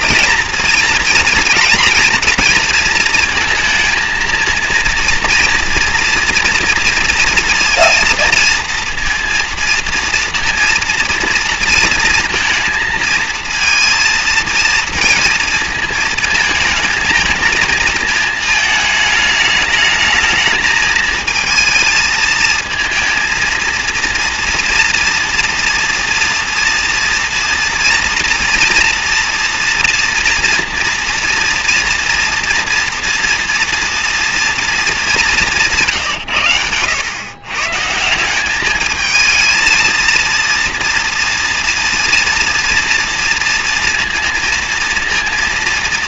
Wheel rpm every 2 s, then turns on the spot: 230, 230, 230, 230, 230, 230, 230, 230, 220, 220, 220, 220, 230, 230, 240, 230, 230, 230, 100, 210, 230, 230, 230.
none